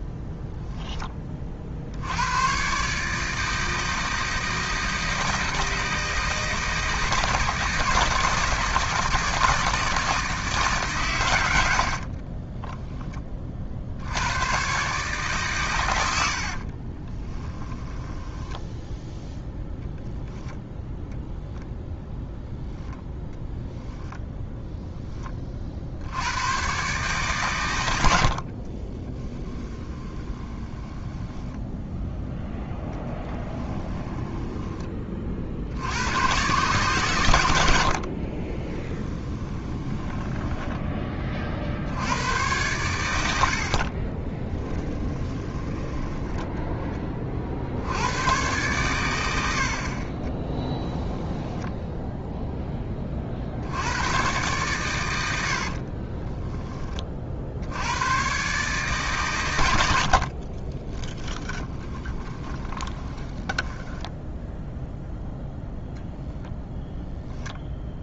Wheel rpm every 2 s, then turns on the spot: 10, 140, 160, 160, 160, 150, 20, 130, 40, 10, 0, 0, 0, 120, 30, 10, 0, 10, 120, 20, 20, 100, 10, 10, 110, 10, 10, 120, 20, 140, 30, 20, 0, 0.
12-14 16-18 28-32 38-40 44-46 50-52 60-64